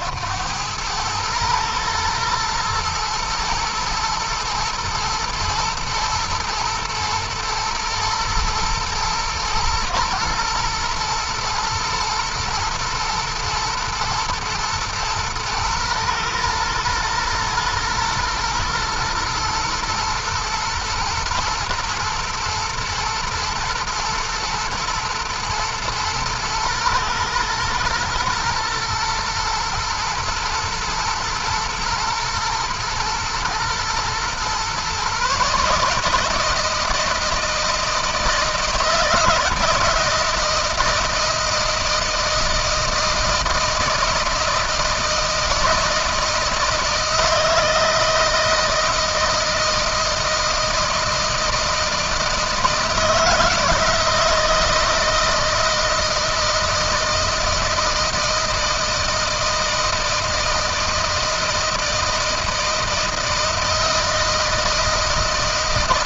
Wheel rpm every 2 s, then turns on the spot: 100, 110, 110, 110, 110, 110, 120, 110, 120, 120, 110, 110, 110, 120, 120, 110, 110, 130, 160, 160, 160, 160, 160, 160, 160, 160, 160, 160, 160, 160, 160, 160, 160.
none